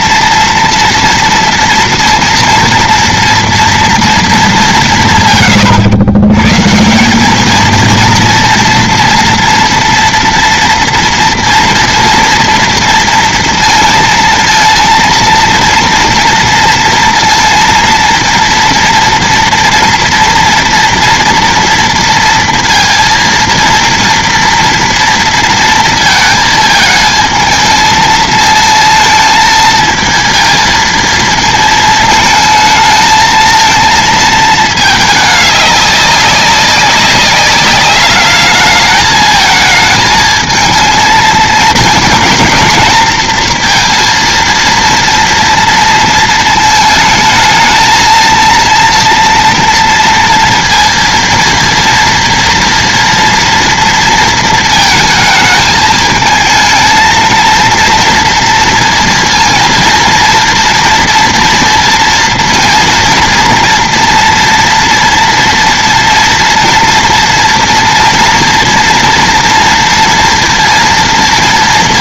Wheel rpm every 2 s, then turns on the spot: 230, 230, 190, 150, 230, 230, 230, 230, 230, 230, 240, 230, 230, 220, 220, 230, 220, 220, 200, 210, 230, 240, 230, 220, 230, 230, 230, 220, 220, 230, 230, 230, 240, 230, 230, 230.
none